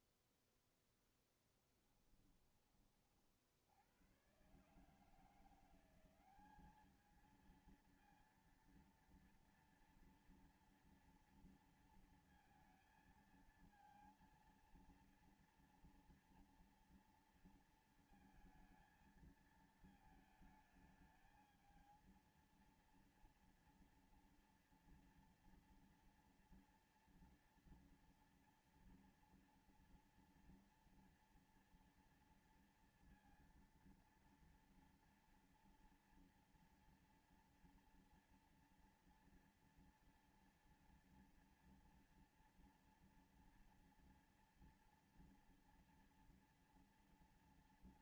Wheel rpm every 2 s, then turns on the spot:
0, 40, 150, 210, 230, 230, 230, 230, 230, 220, 220, 230, 230, 230, 230, 240, 230, 230, 230, 230, 240, 230, 230, 230.
none